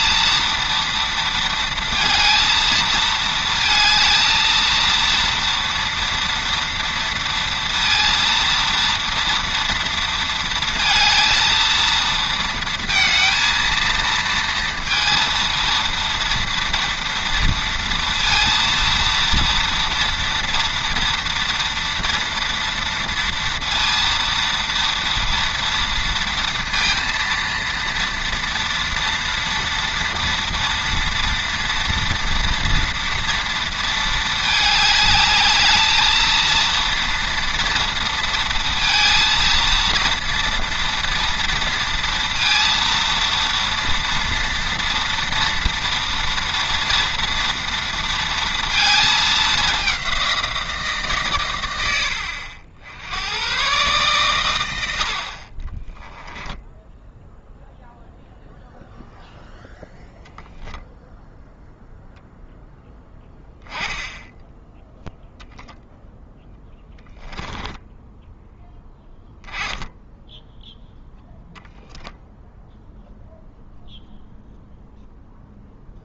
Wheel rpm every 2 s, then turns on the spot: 230, 230, 230, 230, 230, 230, 230, 230, 230, 230, 230, 230, 230, 230, 230, 230, 230, 210, 230, 230, 230, 230, 230, 230, 220, 150, 80, 90, 0, 0, 0, 10, 0, 0, 10, 0, 0, 0.
none